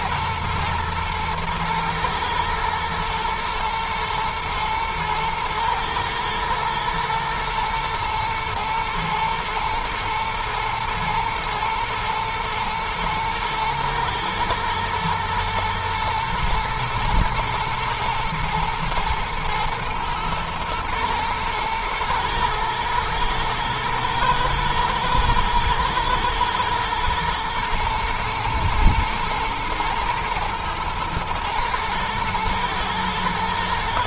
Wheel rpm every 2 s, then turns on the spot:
110, 110, 110, 120, 110, 120, 120, 110, 110, 110, 110, 110, 110, 110, 120, 120, 110.
none